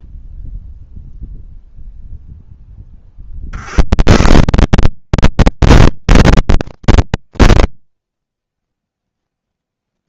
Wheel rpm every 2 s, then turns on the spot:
0, 40, 160, 110, 60.
8-10